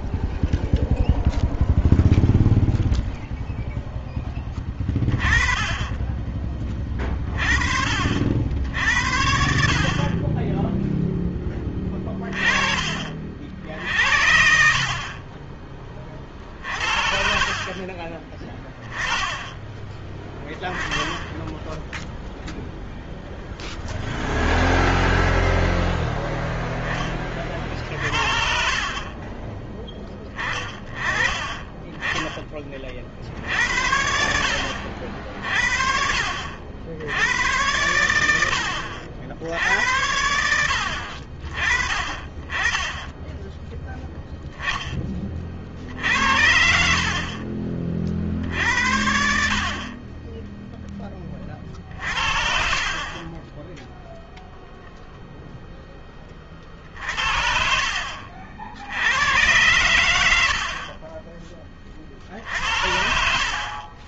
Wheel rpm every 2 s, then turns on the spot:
0, 0, 20, 20, 70, 10, 30, 50, 50, 20, 10, 0, 0, 10, 50, 20, 40, 60, 80, 70, 70, 20, 10, 60, 60, 10, 40, 0, 40, 70, 50, 60.
none